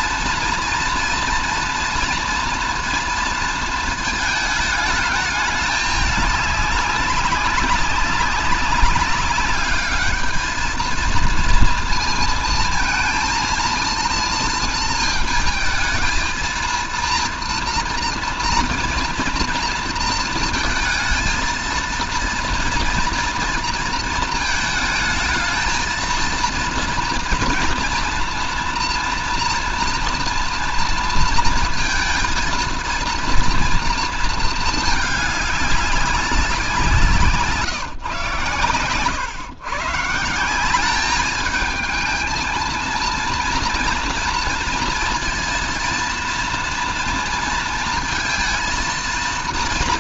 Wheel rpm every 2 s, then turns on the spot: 230, 230, 210, 200, 200, 220, 230, 230, 230, 230, 230, 230, 220, 240, 230, 230, 230, 220, 180, 130, 190, 230, 230, 230, 230.
none